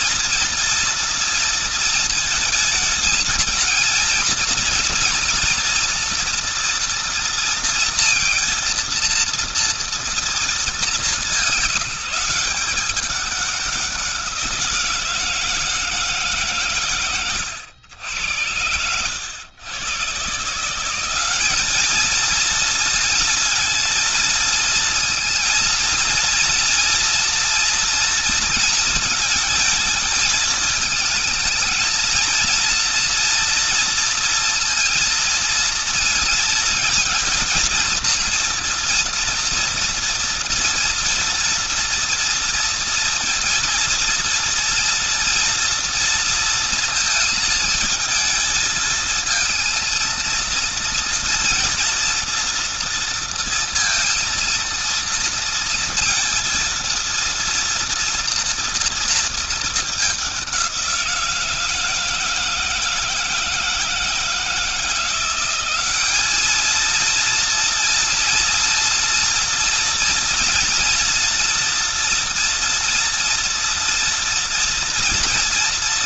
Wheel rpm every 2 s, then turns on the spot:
230, 220, 230, 230, 230, 210, 190, 160, 120, 100, 190, 230, 230, 230, 230, 220, 230, 230, 230, 230, 240, 230, 230, 230, 220, 230, 230, 230, 230, 230, 180, 160, 170, 230, 230, 240, 230, 230.
none